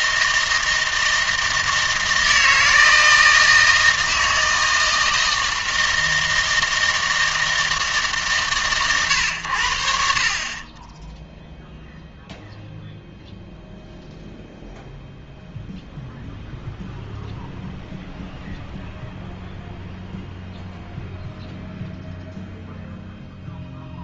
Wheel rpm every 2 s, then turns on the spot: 160, 160, 160, 160, 140, 30, 0, 0, 0, 0, 0, 0.
none